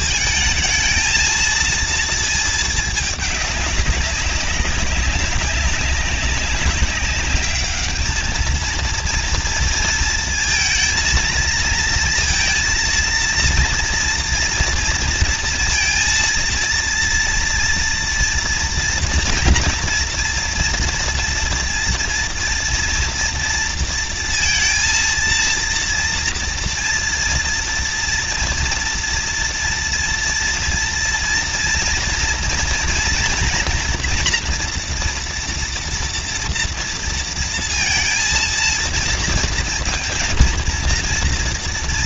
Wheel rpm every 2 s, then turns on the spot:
220, 220, 200, 190, 220, 230, 230, 230, 230, 230, 240, 230, 230, 230, 230, 230, 230, 240, 230, 230, 230.
none